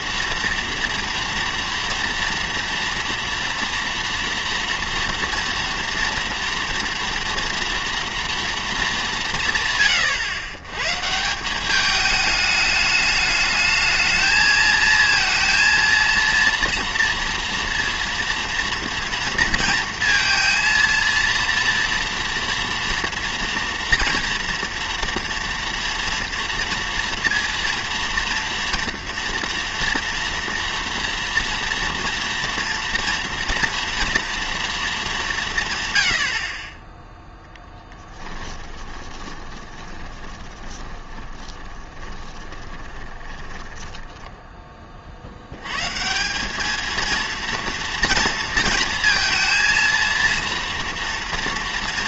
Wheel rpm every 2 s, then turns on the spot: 240, 230, 240, 230, 220, 130, 210, 220, 230, 230, 230, 230, 240, 230, 230, 230, 230, 220, 30, 20, 20, 20, 20, 210, 230, 230.
38-44